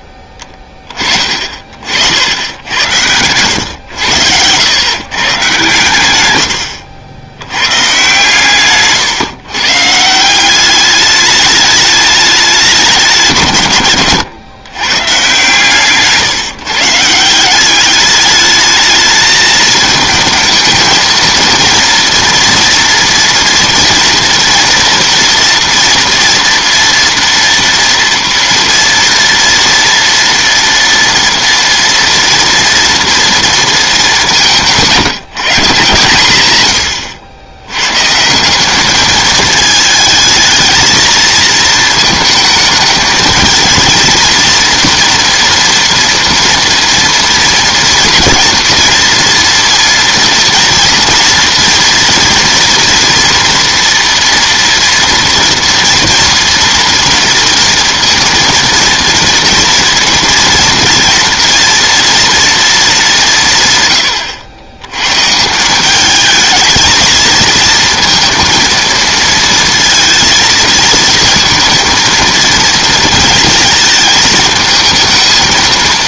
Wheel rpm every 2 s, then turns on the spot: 20, 80, 100, 90, 140, 190, 190, 130, 150, 210, 220, 240, 240, 230, 230, 230, 230, 180, 110, 190, 230, 220, 230, 230, 230, 230, 230, 230, 230, 230, 240, 230, 90, 220, 230, 230, 230, 220.
36-38